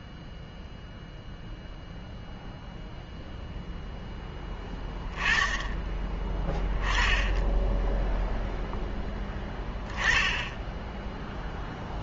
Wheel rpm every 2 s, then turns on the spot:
0, 0, 20, 10, 0, 0.
none